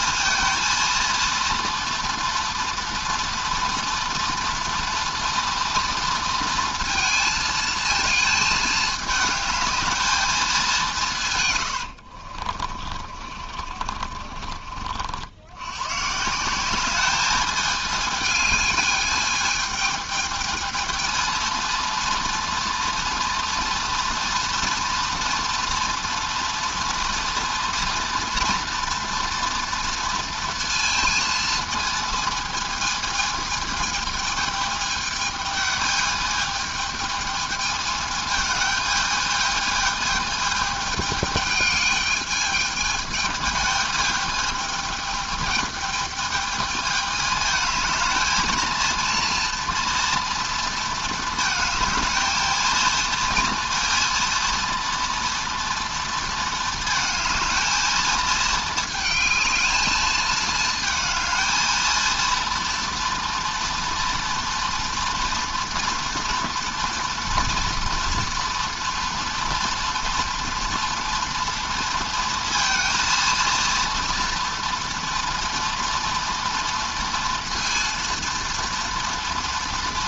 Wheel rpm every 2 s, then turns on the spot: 230, 230, 230, 230, 220, 190, 40, 50, 190, 220, 220, 230, 230, 230, 230, 230, 220, 220, 220, 220, 210, 210, 220, 220, 220, 230, 230, 230, 230, 220, 220, 230, 230, 240, 240, 230, 230, 230, 230, 230.
12-14